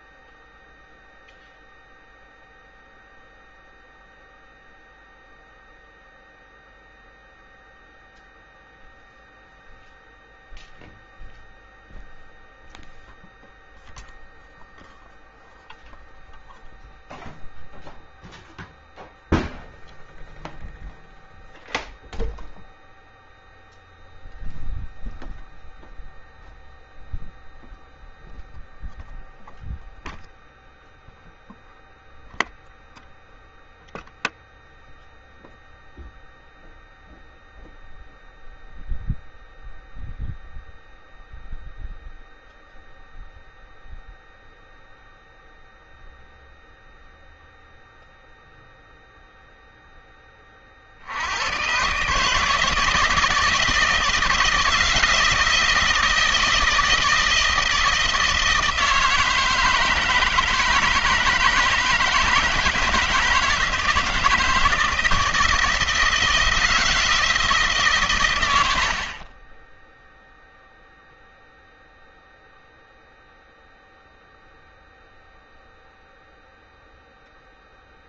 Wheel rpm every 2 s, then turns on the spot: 0, 0, 0, 0, 0, 0, 0, 0, 0, 0, 0, 0, 0, 0, 0, 0, 0, 0, 0, 0, 0, 0, 0, 0, 0, 20, 150, 160, 160, 160, 160, 160, 160, 160, 120, 0, 0, 0, 0.
none